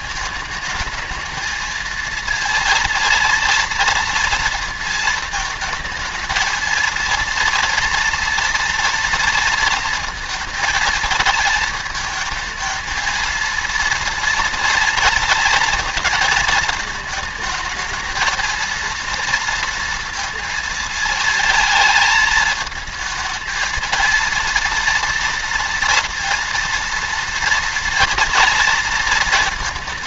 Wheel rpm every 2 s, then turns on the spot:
220, 230, 230, 220, 230, 220, 220, 230, 220, 230, 230, 220, 230, 230, 230.
none